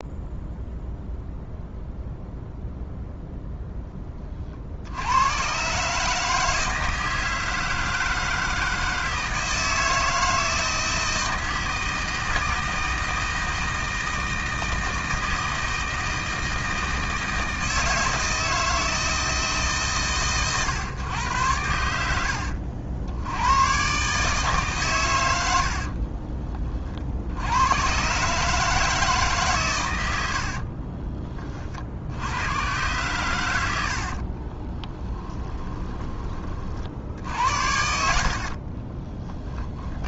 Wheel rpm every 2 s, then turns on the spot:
0, 0, 80, 160, 160, 160, 160, 160, 160, 160, 110, 80, 110, 50, 150, 30, 110, 10, 60, 40.
30-32 34-36 38-40